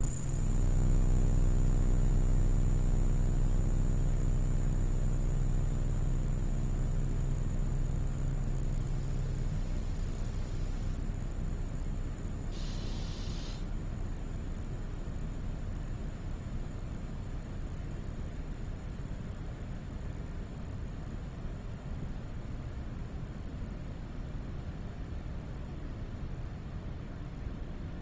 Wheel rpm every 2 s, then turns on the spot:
0, 0, 0, 0, 0, 0, 0, 0, 0, 0, 0, 0, 0, 0.
none